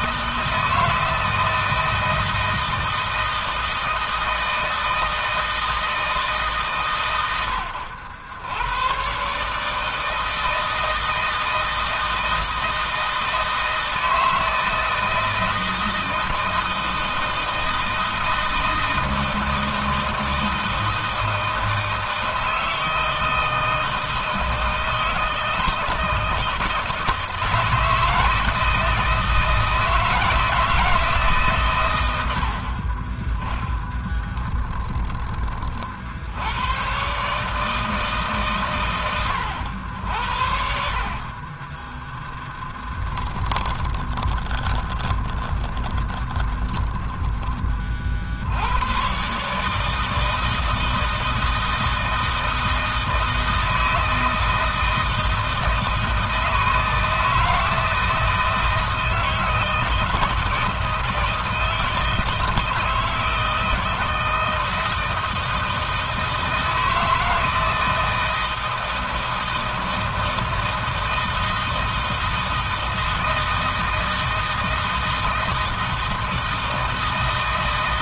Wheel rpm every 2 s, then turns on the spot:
160, 160, 160, 120, 120, 160, 160, 160, 160, 160, 160, 160, 160, 160, 160, 160, 30, 10, 110, 120, 50, 20, 20, 10, 110, 160, 160, 160, 160, 160, 160, 160, 160, 160, 160, 160, 160, 160, 160.
42-48